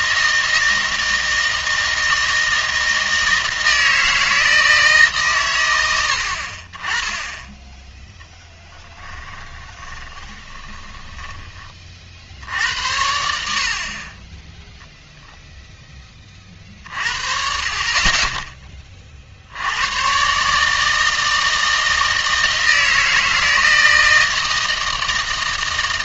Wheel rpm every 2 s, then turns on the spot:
160, 160, 160, 30, 10, 30, 70, 0, 40, 20, 150, 160, 160.
8-12